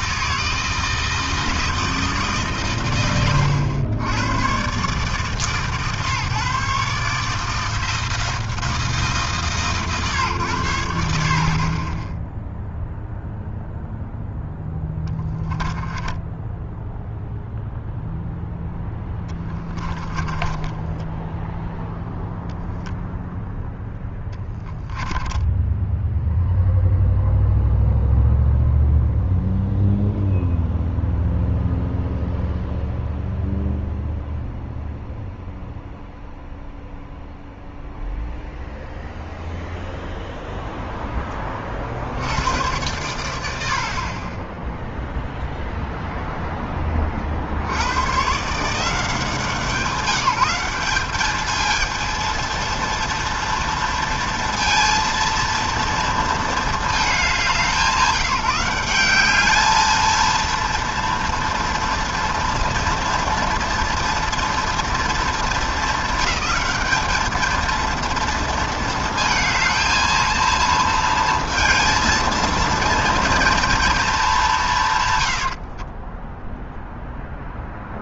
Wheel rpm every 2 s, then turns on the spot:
160, 110, 140, 160, 140, 50, 0, 10, 0, 10, 0, 0, 10, 0, 0, 0, 0, 0, 0, 0, 20, 90, 0, 50, 180, 210, 230, 230, 190, 210, 230, 230, 230, 220, 220, 230, 230, 80, 0.
14-16 24-26 74-76